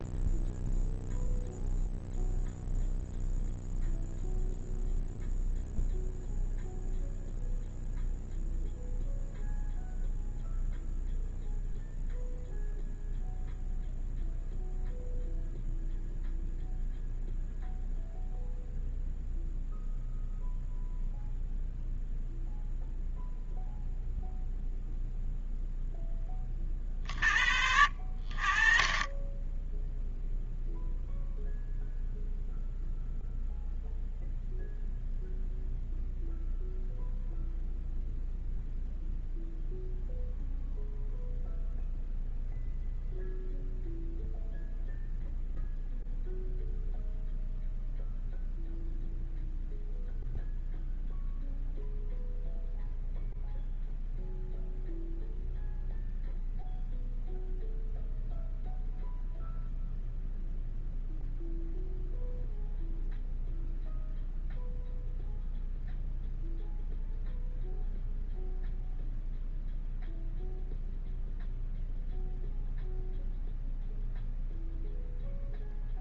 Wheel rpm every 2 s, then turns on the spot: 0, 0, 0, 0, 0, 0, 0, 0, 0, 0, 0, 0, 0, 20, 20, 0, 0, 0, 0, 0, 0, 0, 0, 0, 0, 0, 0, 0, 0, 0, 0, 0, 0, 0, 0, 0, 0, 0.
none